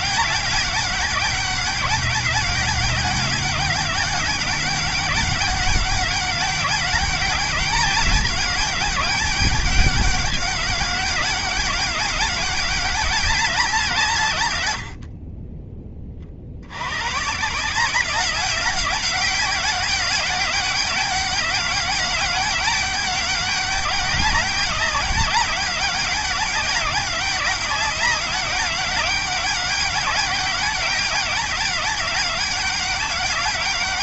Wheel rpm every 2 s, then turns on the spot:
200, 210, 200, 210, 200, 200, 200, 60, 100, 200, 200, 200, 200, 200, 200, 200, 200.
none